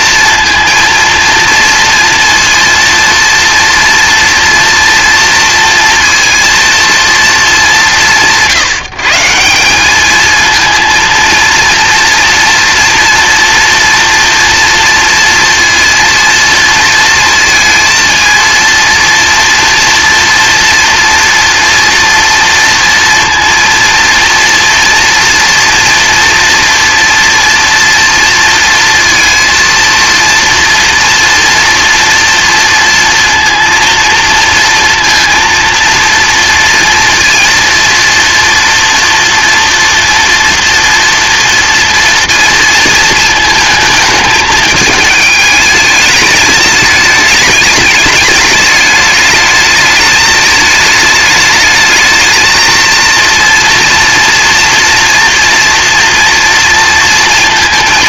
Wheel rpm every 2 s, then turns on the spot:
230, 230, 240, 230, 150, 230, 230, 240, 230, 230, 230, 230, 230, 230, 230, 230, 230, 230, 230, 230, 230, 230, 210, 210, 210, 210, 220, 230, 230.
none